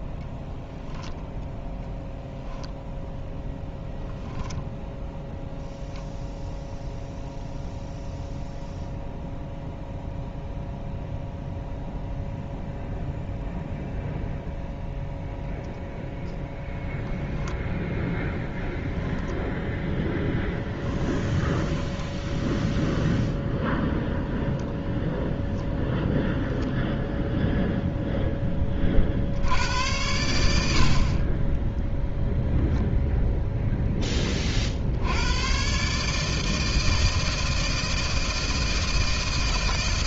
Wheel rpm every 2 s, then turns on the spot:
0, 0, 0, 0, 0, 0, 0, 0, 0, 10, 20, 0, 0, 0, 20, 70, 0, 60, 160, 160.
18-22